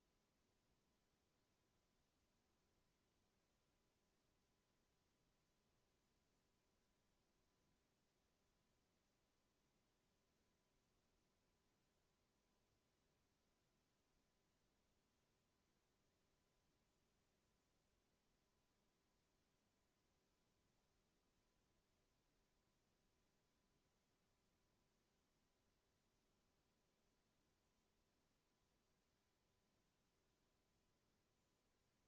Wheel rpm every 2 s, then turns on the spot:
0, 0, 0, 0, 0, 0, 0, 0, 0, 0, 0, 0, 0, 0, 0, 0.
none